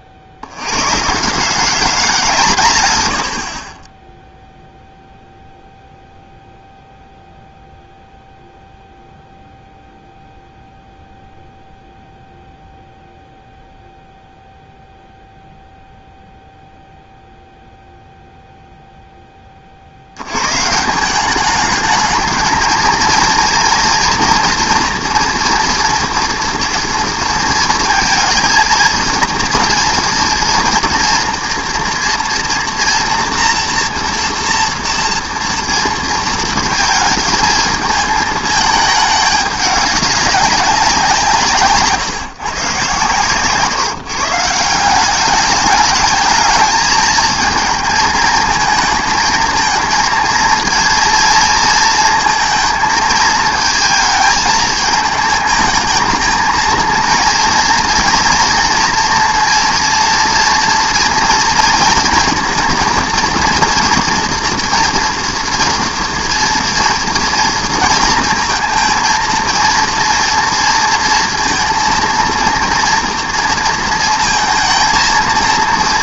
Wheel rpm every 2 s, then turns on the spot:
90, 140, 0, 0, 0, 0, 0, 0, 0, 0, 130, 220, 240, 230, 230, 240, 230, 230, 220, 220, 190, 130, 170, 220, 220, 230, 230, 220, 230, 240, 230, 230, 240, 230, 220, 230, 230, 230.
none